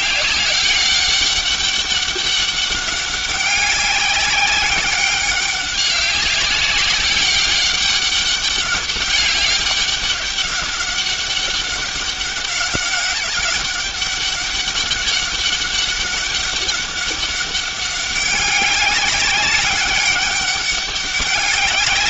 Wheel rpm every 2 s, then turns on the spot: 200, 200, 200, 200, 200, 200, 200, 200, 200, 200, 200.
none